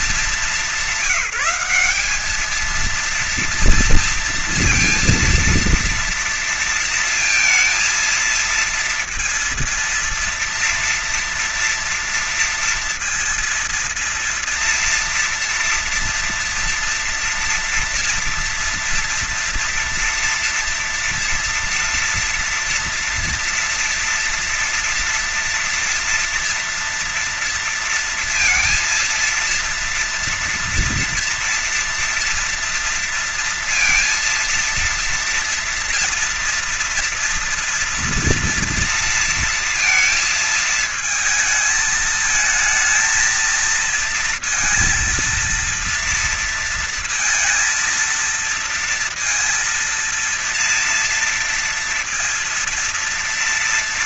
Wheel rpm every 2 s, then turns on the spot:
210, 210, 230, 230, 230, 240, 230, 230, 230, 230, 230, 230, 230, 240, 230, 230, 230, 230, 230, 230, 220, 220, 230, 230, 230, 230, 230.
none